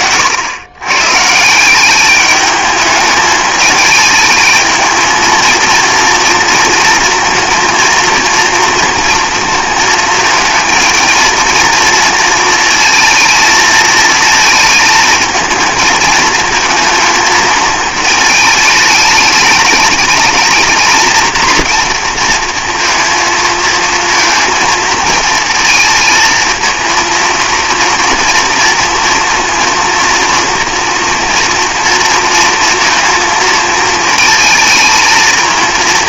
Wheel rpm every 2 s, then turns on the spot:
130, 210, 220, 230, 230, 220, 230, 220, 220, 210, 230, 230, 220, 230, 230, 240, 230, 230.
none